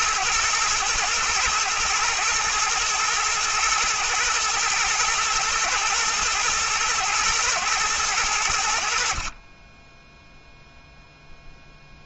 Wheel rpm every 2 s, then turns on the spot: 110, 120, 110, 120, 80, 0.
none